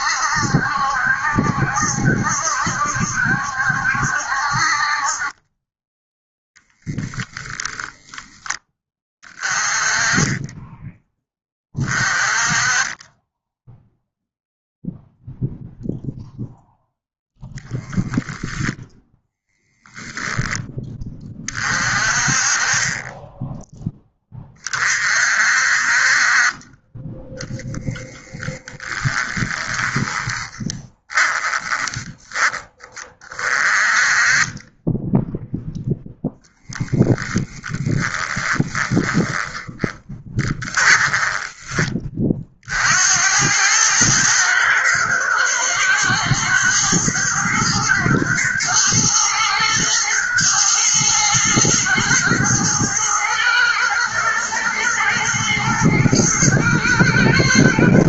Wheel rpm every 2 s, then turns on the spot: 70, 70, 40, 0, 20, 10, 20, 0, 0, 10, 30, 20, 40, 20, 20, 10, 30, 10, 10, 10, 20, 70, 110, 110, 120, 120, 120, 120, 110.
28-32 38-42